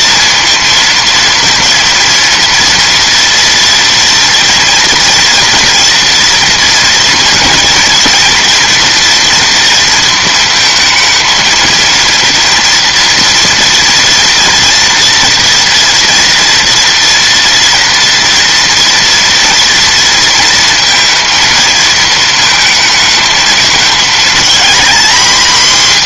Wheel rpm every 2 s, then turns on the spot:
230, 230, 230, 230, 230, 220, 230, 230, 230, 230, 230, 220, 230.
none